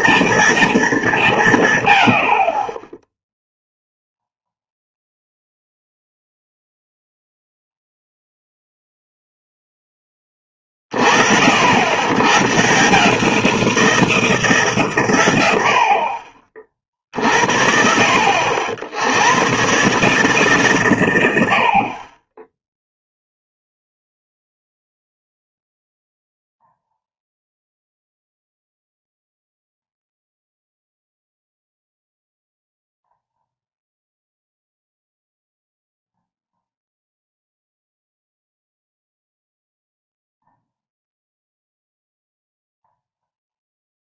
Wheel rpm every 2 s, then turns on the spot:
220, 40, 0, 0, 0, 30, 130, 160, 40, 70, 140, 10, 0, 0, 0, 0, 0, 0, 0, 0, 0, 0.
none